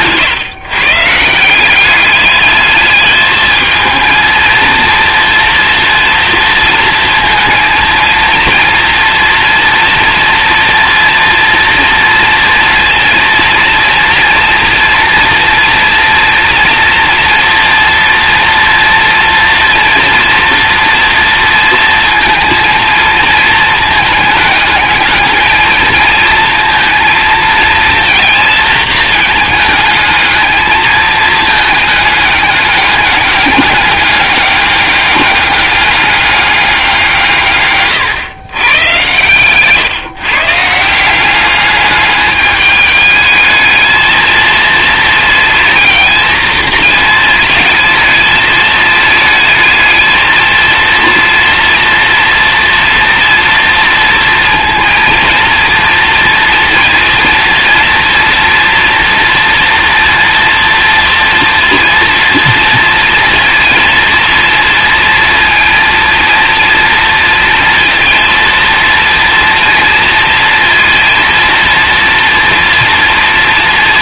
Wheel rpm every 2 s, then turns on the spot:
130, 210, 230, 230, 230, 240, 230, 230, 230, 230, 240, 230, 210, 230, 230, 220, 200, 200, 180, 100, 150, 210, 220, 230, 220, 230, 240, 230, 230, 230, 230, 230, 230, 230, 230, 230, 230.
none